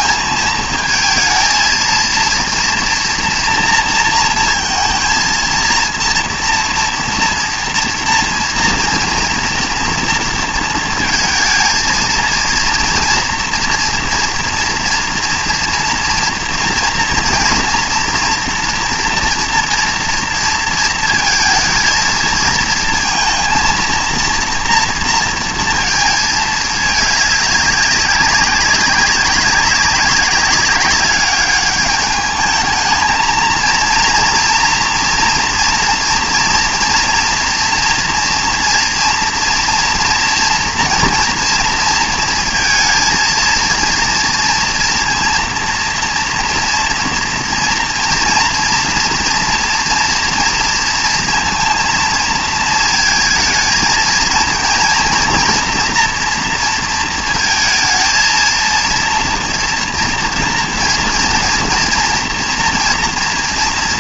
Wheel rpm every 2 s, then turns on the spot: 220, 240, 230, 230, 240, 230, 230, 230, 230, 230, 230, 220, 230, 210, 190, 200, 220, 240, 230, 230, 230, 230, 230, 230, 230, 230, 220, 230, 230, 230, 230, 230.
none